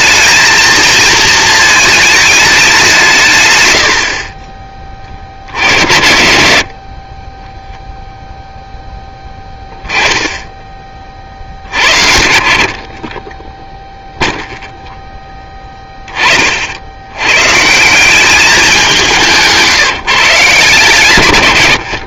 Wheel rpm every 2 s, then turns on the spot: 220, 130, 50, 20, 10, 40, 30, 0, 80, 190, 140.
none